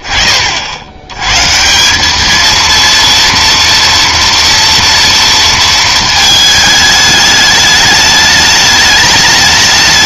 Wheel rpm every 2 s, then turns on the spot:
40, 220, 230, 220, 210.
none